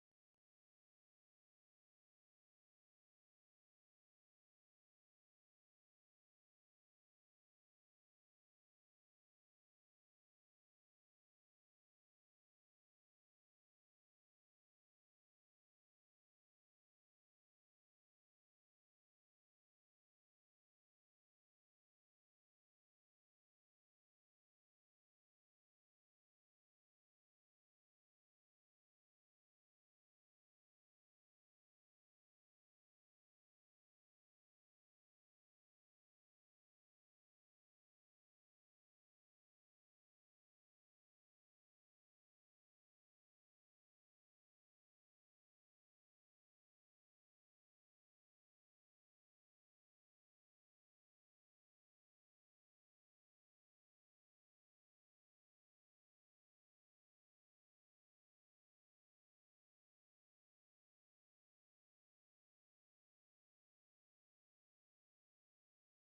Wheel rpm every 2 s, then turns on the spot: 0, 0, 0, 0, 0, 0, 0, 0, 0, 0, 0, 0, 0, 0, 0, 0, 0, 0, 0, 0, 0, 0, 0, 0, 0, 0, 0, 0, 0, 0, 0, 0, 0.
none